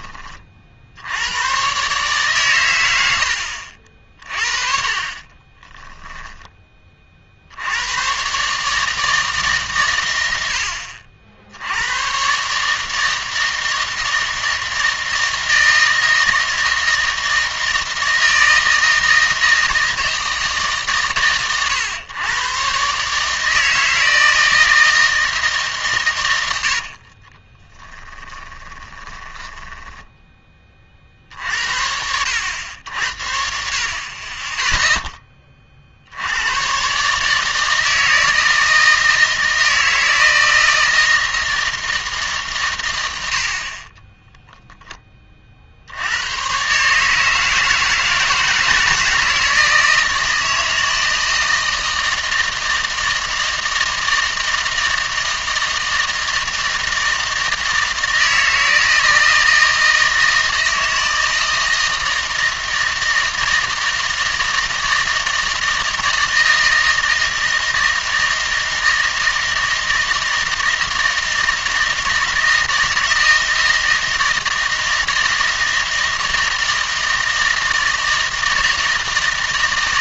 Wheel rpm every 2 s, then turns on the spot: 60, 110, 30, 20, 150, 70, 150, 160, 160, 160, 150, 130, 160, 80, 20, 30, 80, 10, 120, 160, 160, 130, 20, 140, 160, 160, 160, 160, 160, 160, 160, 160, 160, 160, 160, 160, 160, 160, 160, 160.
4-6 26-30